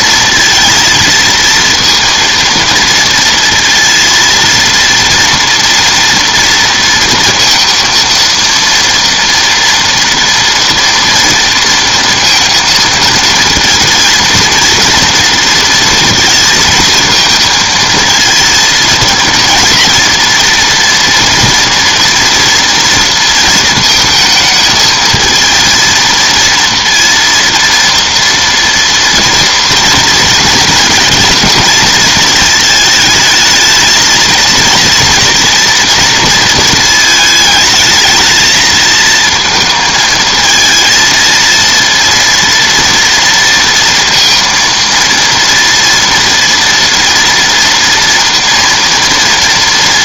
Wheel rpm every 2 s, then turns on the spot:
230, 230, 230, 230, 230, 230, 230, 230, 230, 230, 230, 230, 220, 230, 230, 230, 220, 230, 220, 220, 230, 230, 230, 230, 230.
none